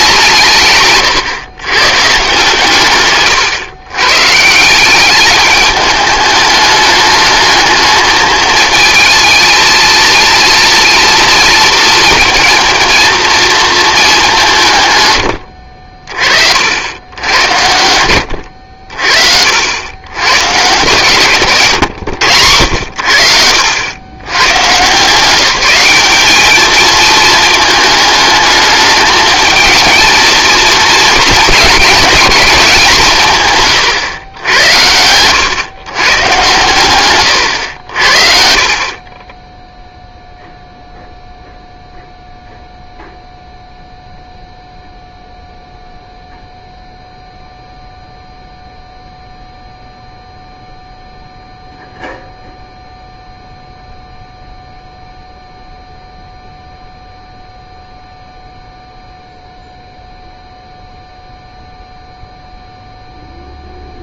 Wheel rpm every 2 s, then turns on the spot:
150, 140, 170, 210, 220, 230, 230, 150, 70, 70, 140, 110, 140, 210, 210, 230, 190, 90, 120, 50, 0, 0, 0, 0, 0, 0, 0, 0, 0, 0, 0, 0.
none